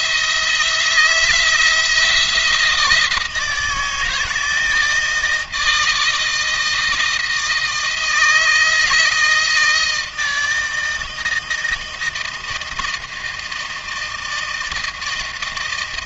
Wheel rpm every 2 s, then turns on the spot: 170, 170, 160, 160, 160, 160, 160, 160.
none